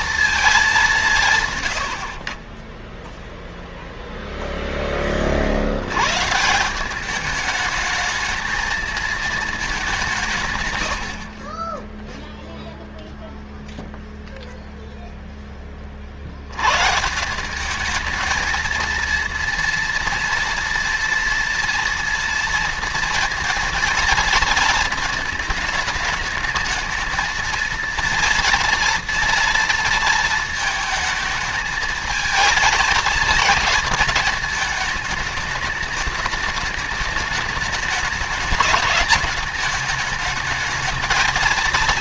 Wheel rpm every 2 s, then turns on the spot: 170, 10, 20, 190, 230, 90, 0, 0, 140, 230, 230, 230, 220, 220, 230, 220, 220, 220, 210, 210, 220.
none